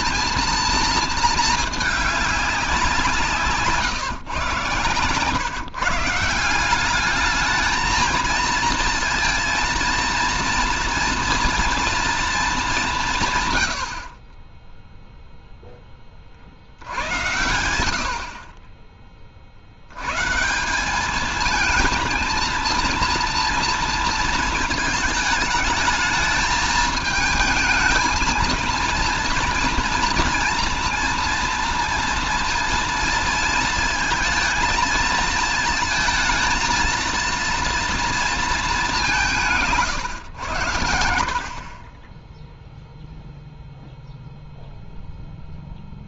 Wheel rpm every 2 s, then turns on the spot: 230, 170, 130, 190, 230, 230, 190, 0, 80, 30, 180, 230, 220, 220, 230, 230, 230, 220, 230, 210, 100, 0, 0.
none